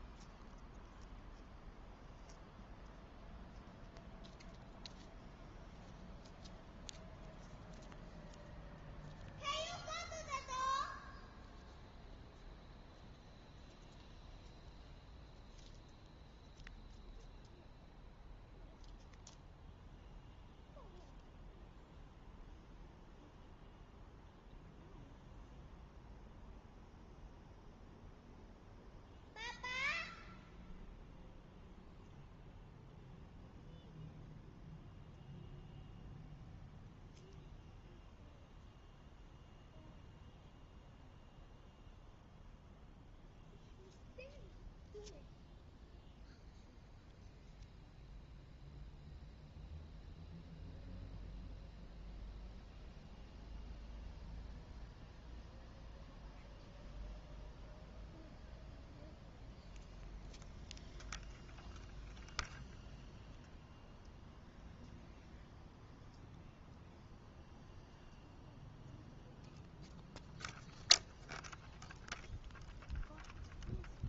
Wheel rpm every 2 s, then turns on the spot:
0, 0, 0, 0, 0, 0, 0, 0, 0, 0, 0, 0, 0, 0, 0, 0, 0, 0, 0, 0, 0, 0, 0, 0, 0, 0, 0, 0, 0, 0, 0, 0, 0, 0, 0, 0, 0.
none